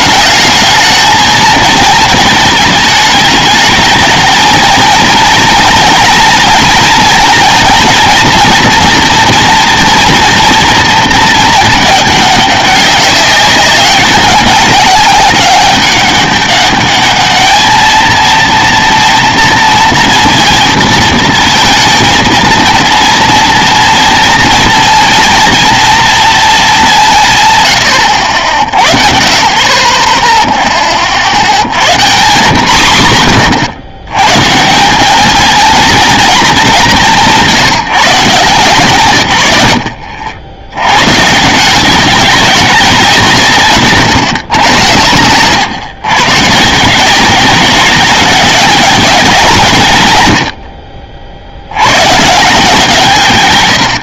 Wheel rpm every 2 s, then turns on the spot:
220, 220, 220, 230, 230, 230, 210, 200, 200, 230, 230, 230, 230, 210, 60, 20, 110, 160, 200, 150, 90, 190, 100, 150, 210, 70, 150.
none